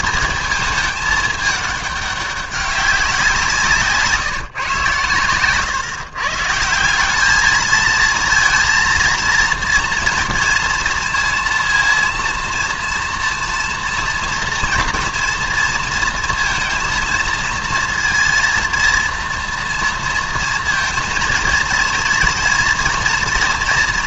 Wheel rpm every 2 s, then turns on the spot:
220, 200, 130, 170, 230, 230, 230, 230, 230, 230, 230, 240.
none